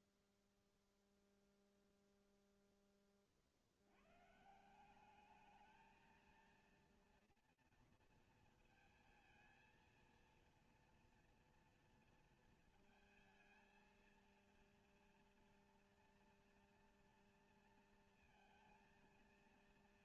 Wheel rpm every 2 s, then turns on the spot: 0, 100, 220, 230, 230, 230, 230, 230, 230, 230.
none